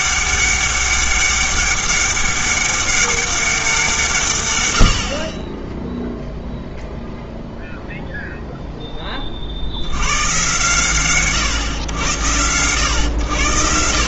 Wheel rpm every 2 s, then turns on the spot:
200, 200, 100, 0, 10, 130, 100.
none